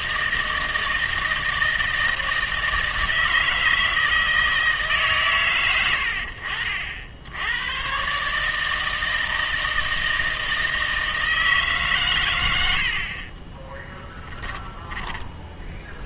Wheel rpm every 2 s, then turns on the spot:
160, 160, 160, 60, 160, 160, 70, 10.
14-16